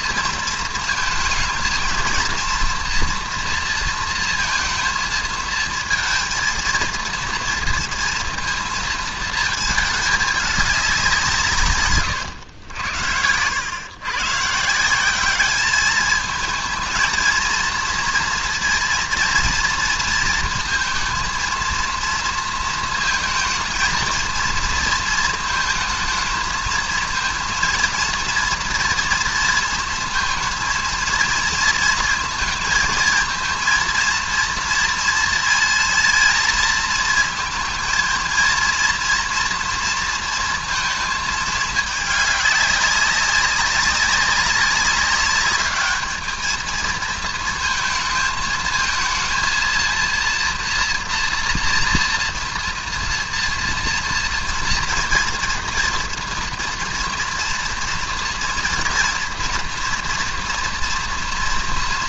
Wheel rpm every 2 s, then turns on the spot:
230, 230, 230, 220, 230, 190, 90, 160, 220, 230, 230, 230, 230, 230, 240, 230, 220, 230, 220, 230, 230, 200, 200, 220, 220, 230, 230, 230, 230, 230, 230.
none